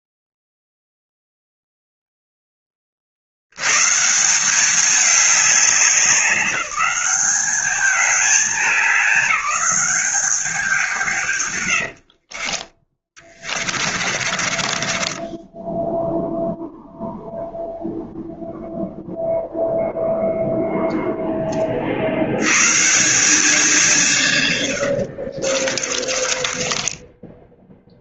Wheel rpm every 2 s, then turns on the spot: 0, 30, 200, 200, 210, 170, 30, 20, 0, 0, 0, 140, 100, 20.
12-16 24-28